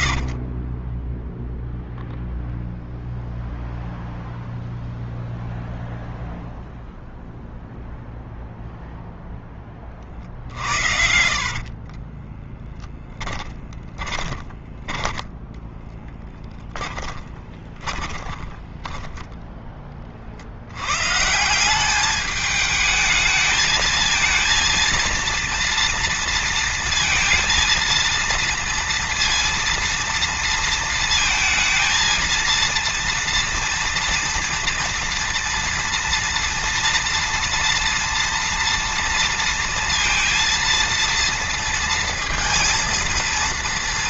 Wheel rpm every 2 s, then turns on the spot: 20, 0, 0, 0, 0, 60, 30, 10, 10, 10, 100, 210, 230, 230, 230, 230, 230, 230, 230, 230, 230, 230.
10-14 16-20